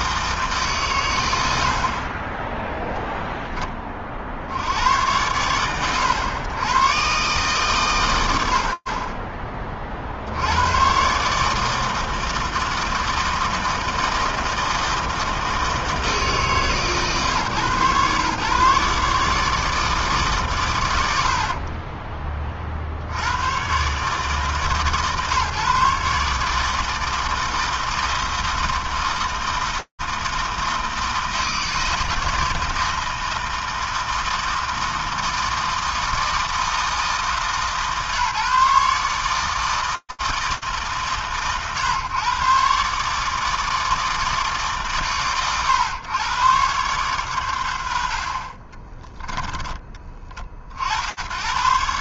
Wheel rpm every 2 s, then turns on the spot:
160, 40, 30, 90, 120, 40, 160, 160, 160, 120, 150, 40, 110, 140, 160, 160, 160, 160, 160, 150, 160, 130, 160, 120, 90, 20.
none